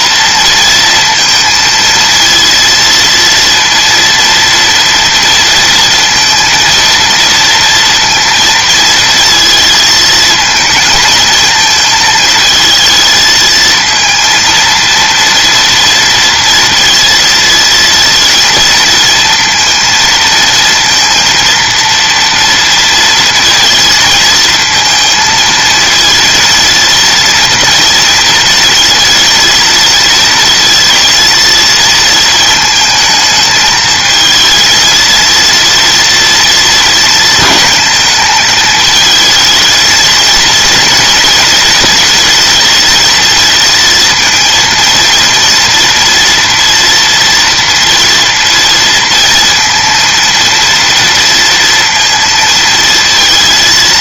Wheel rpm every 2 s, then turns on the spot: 230, 230, 230, 230, 230, 220, 220, 230, 230, 230, 230, 230, 230, 230, 230, 220, 220, 230, 230, 220, 230, 230, 230, 230, 230, 230, 230.
none